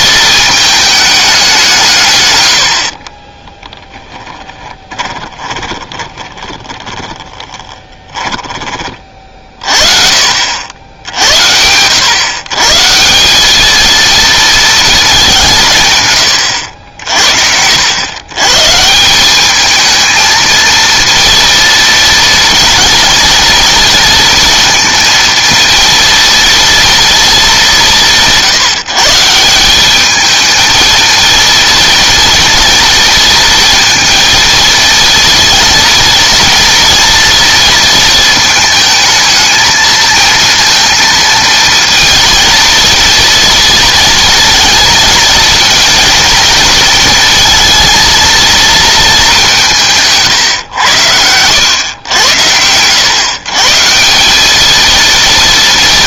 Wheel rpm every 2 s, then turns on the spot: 220, 70, 20, 20, 30, 80, 160, 220, 80, 140, 230, 230, 230, 230, 150, 220, 230, 230, 230, 220, 230, 230, 230, 220, 220, 110, 100, 220.
4-8